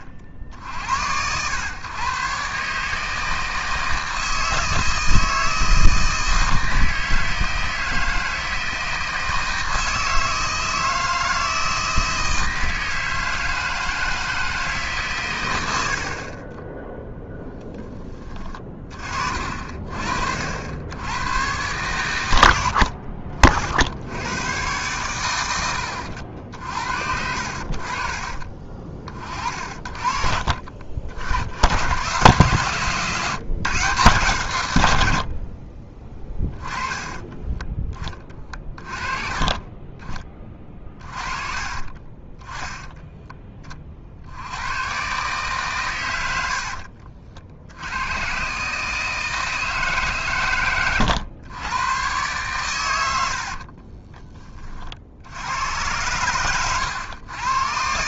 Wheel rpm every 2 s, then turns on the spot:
50, 140, 160, 160, 160, 160, 160, 160, 20, 30, 70, 90, 110, 60, 30, 40, 130, 130, 10, 30, 20, 10, 100, 80, 140, 110, 120, 30, 110.
16-18 46-48